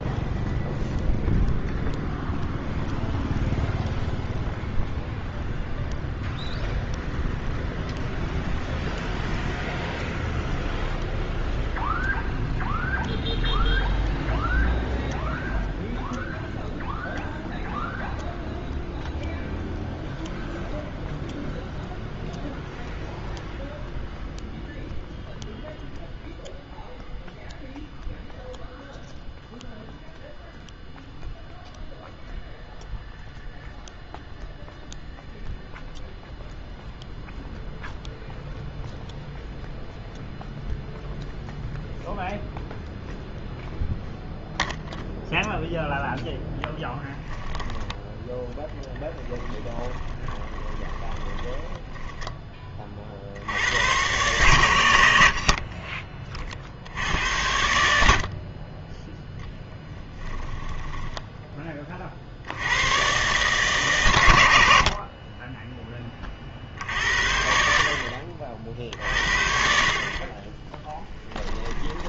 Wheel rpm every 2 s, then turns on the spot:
0, 0, 0, 0, 0, 0, 0, 0, 0, 0, 0, 0, 0, 0, 0, 0, 0, 0, 0, 0, 0, 0, 0, 0, 10, 10, 30, 80, 70, 30, 10, 100, 60, 50, 40, 10.
50-52 60-62